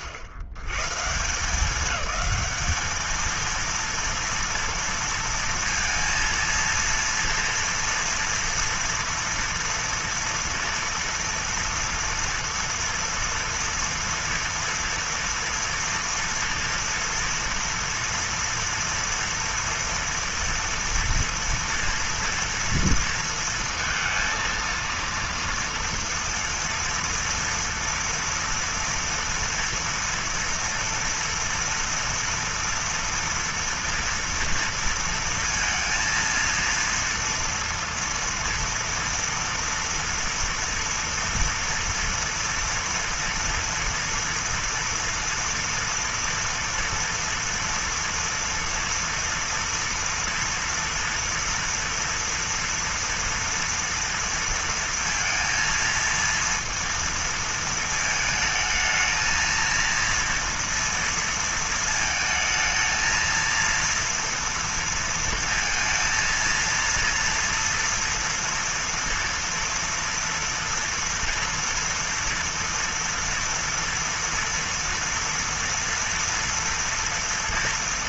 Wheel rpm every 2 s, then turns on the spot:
110, 210, 230, 230, 230, 230, 230, 230, 230, 230, 230, 230, 230, 230, 230, 230, 230, 230, 230, 230, 230, 240, 230, 230, 230, 240, 230, 230, 230, 220, 230, 220, 230, 230, 230, 230, 230, 230, 230.
none